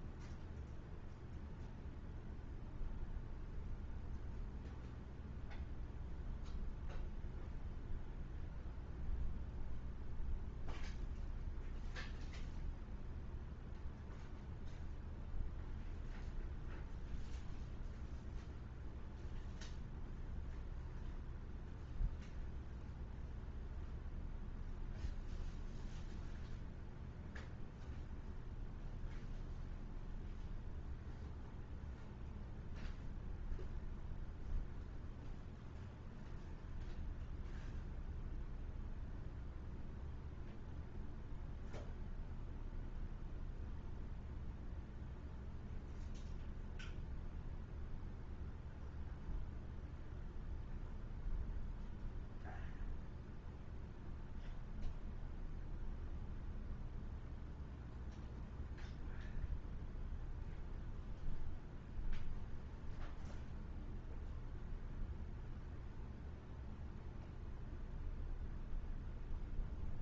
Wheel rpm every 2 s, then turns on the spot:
0, 0, 0, 0, 0, 0, 0, 0, 0, 0, 0, 0, 0, 0, 0, 0, 0, 0, 0, 0, 0, 0, 0, 0, 0, 0, 0, 0, 0, 0, 0, 0, 0, 0, 0.
none